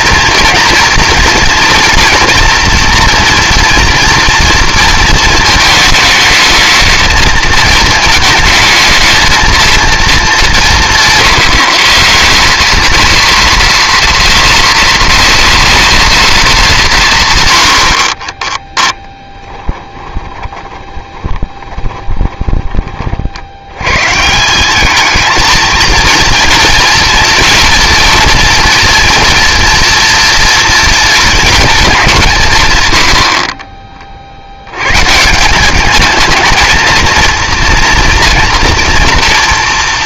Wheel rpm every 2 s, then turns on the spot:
230, 230, 230, 220, 220, 190, 200, 230, 210, 10, 20, 20, 190, 230, 240, 230, 140, 90, 220, 230.
18-24 32-34